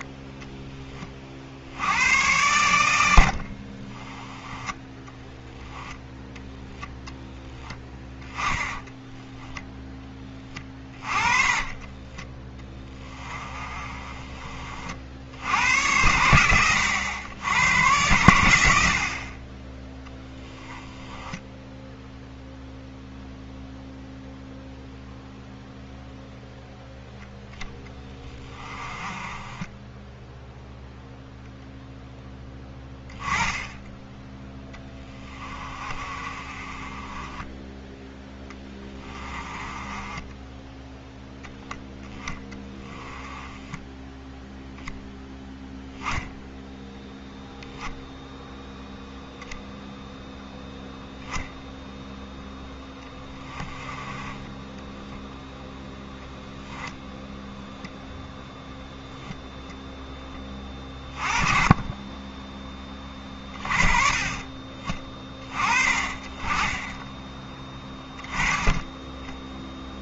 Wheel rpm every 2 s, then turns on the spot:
20, 80, 10, 0, 10, 30, 20, 60, 100, 50, 10, 0, 0, 0, 20, 0, 10, 10, 20, 20, 0, 10, 0, 0, 0, 0, 10, 10, 0, 0, 20, 20, 30, 10, 10.
8-14 20-22 28-30 34-40 42-44 54-56